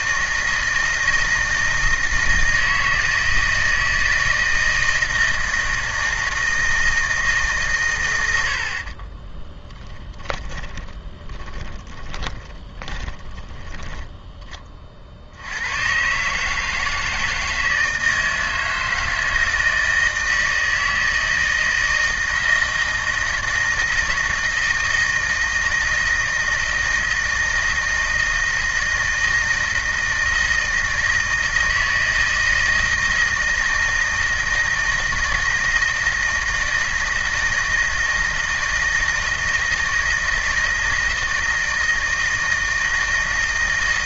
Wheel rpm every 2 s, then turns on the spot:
160, 160, 160, 160, 60, 20, 20, 30, 150, 160, 160, 160, 160, 160, 160, 160, 160, 160, 160, 160, 160, 160.
10-14